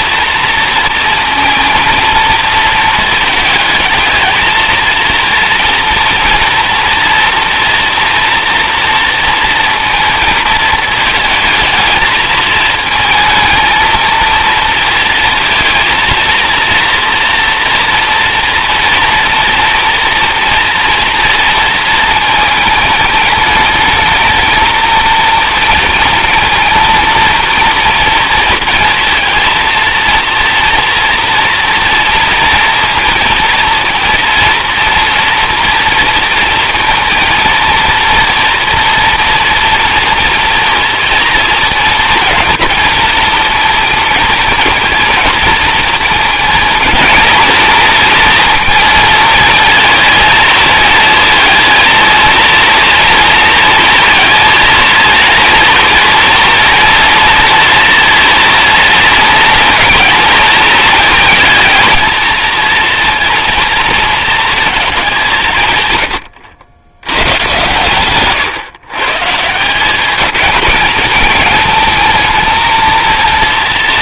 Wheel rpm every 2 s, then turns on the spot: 230, 230, 220, 230, 230, 220, 220, 230, 230, 230, 230, 220, 220, 230, 230, 230, 230, 230, 230, 230, 230, 230, 230, 230, 230, 230, 230, 230, 240, 230, 230, 230, 220, 80, 120, 210, 230.
none